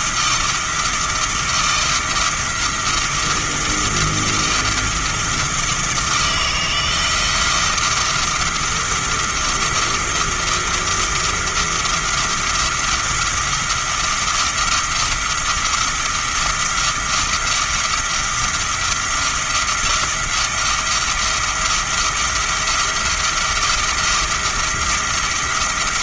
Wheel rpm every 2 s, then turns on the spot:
160, 160, 170, 160, 170, 170, 170, 170, 170, 170, 170, 170, 170.
none